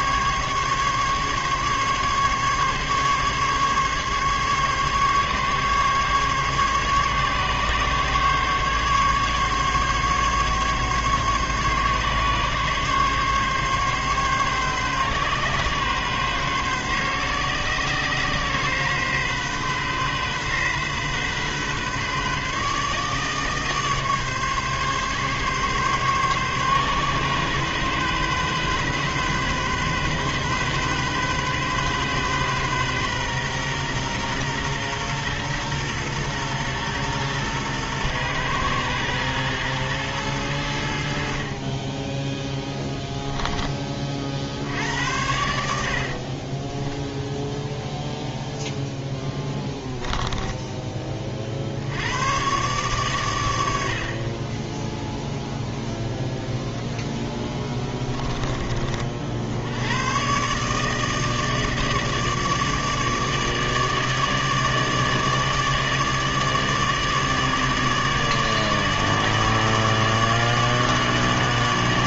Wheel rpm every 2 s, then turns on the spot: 140, 140, 140, 140, 140, 140, 140, 140, 130, 130, 130, 150, 140, 130, 130, 130, 130, 120, 120, 120, 90, 10, 60, 20, 0, 10, 120, 20, 0, 20, 140, 150, 150, 150, 150, 150.
42-44 46-48